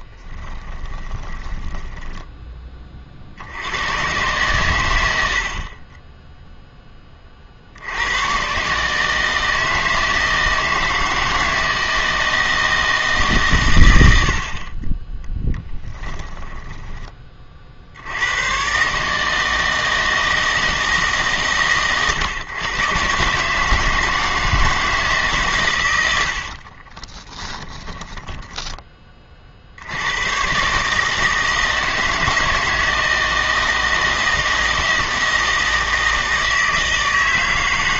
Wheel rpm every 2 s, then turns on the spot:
20, 20, 110, 0, 130, 160, 160, 40, 10, 120, 160, 120, 160, 50, 10, 130, 160, 160, 160.
0-2 16-18 26-30